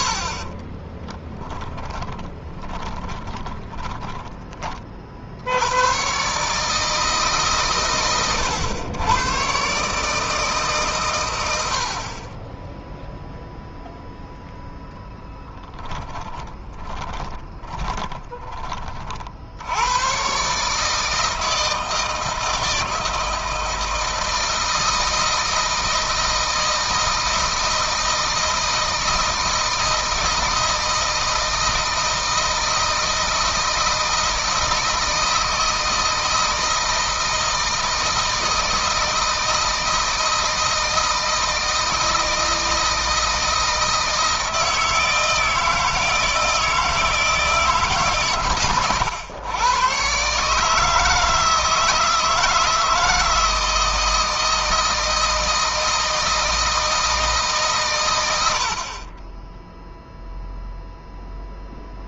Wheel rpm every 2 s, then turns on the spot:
20, 10, 40, 150, 100, 130, 10, 0, 20, 30, 150, 160, 160, 160, 160, 160, 160, 160, 160, 160, 160, 160, 160, 160, 120, 150, 160, 160, 160, 60, 0.
0-4 16-18